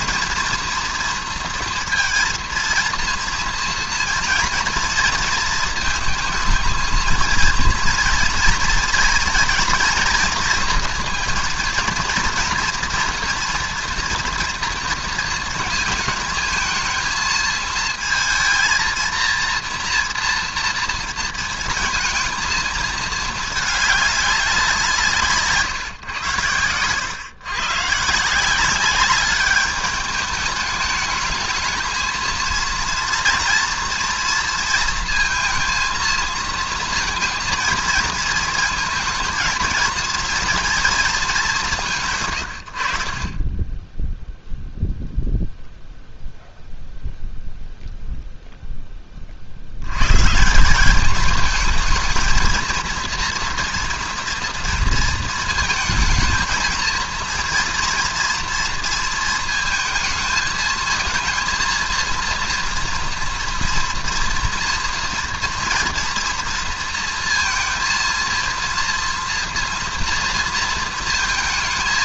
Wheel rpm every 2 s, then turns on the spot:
240, 230, 230, 220, 230, 240, 230, 230, 220, 230, 230, 230, 190, 110, 180, 210, 230, 230, 230, 220, 230, 90, 0, 0, 0, 170, 220, 230, 220, 230, 220, 230, 230, 230, 230, 230.
26-28